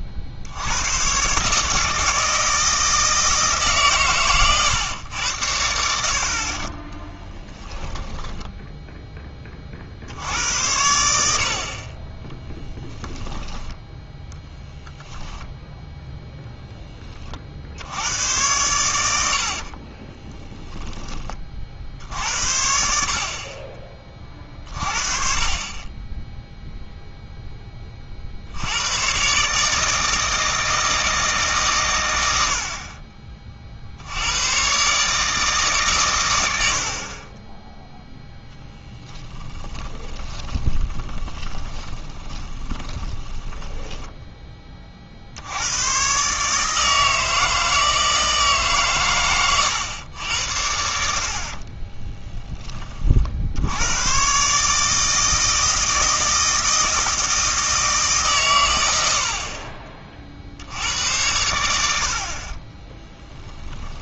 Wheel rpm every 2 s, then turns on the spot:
110, 160, 120, 30, 10, 90, 10, 0, 10, 100, 10, 60, 40, 0, 90, 160, 70, 120, 70, 10, 20, 20, 20, 150, 150, 80, 30, 150, 160, 100, 80, 20.
6-10 40-44 62-64